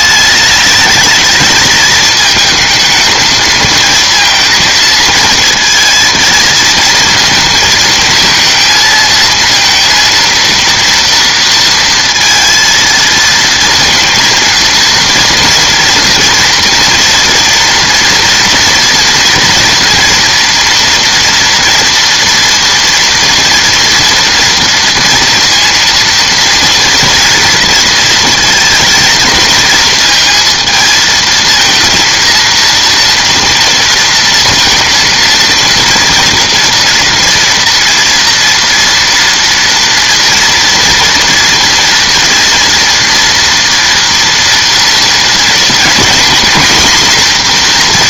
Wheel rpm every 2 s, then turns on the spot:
210, 220, 230, 230, 230, 230, 230, 230, 230, 240, 230, 230, 230, 230, 230, 220, 230, 230, 230, 230, 240, 230, 230, 240.
none